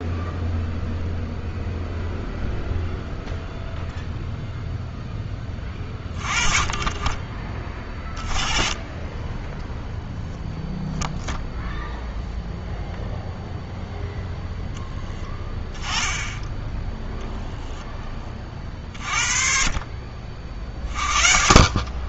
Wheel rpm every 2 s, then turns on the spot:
0, 0, 0, 40, 20, 0, 0, 10, 10, 40, 40.
none